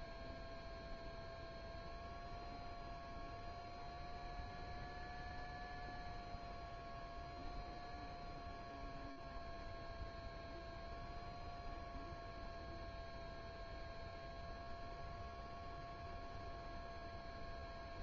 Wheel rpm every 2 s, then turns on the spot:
0, 0, 0, 0, 0, 0, 0, 0, 0.
none